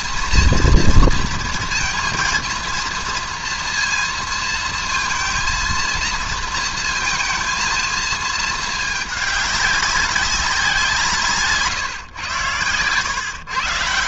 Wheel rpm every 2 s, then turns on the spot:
230, 230, 230, 230, 220, 190, 110.
none